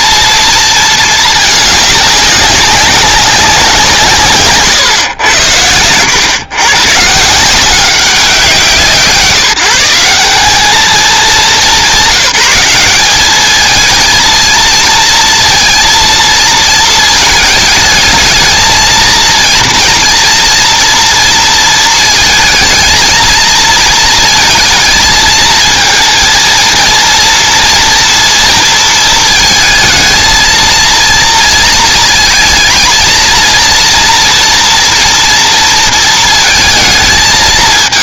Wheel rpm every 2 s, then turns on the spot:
230, 200, 130, 130, 160, 210, 200, 230, 220, 220, 230, 230, 230, 230, 230, 230, 230, 230, 220.
none